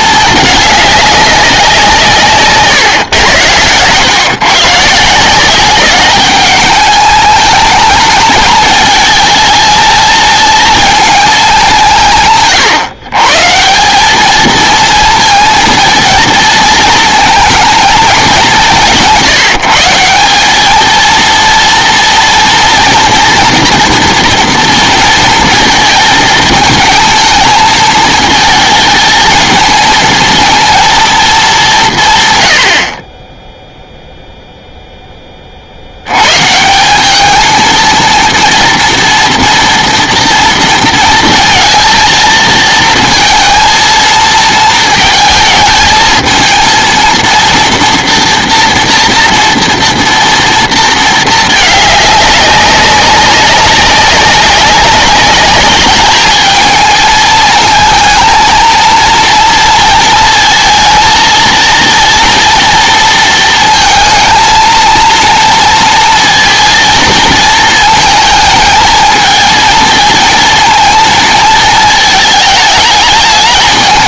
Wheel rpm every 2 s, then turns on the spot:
200, 130, 150, 210, 220, 230, 140, 220, 220, 180, 220, 240, 230, 220, 220, 230, 50, 10, 190, 240, 230, 230, 220, 230, 240, 230, 190, 200, 220, 230, 230, 230, 230, 230, 220, 230, 210.
none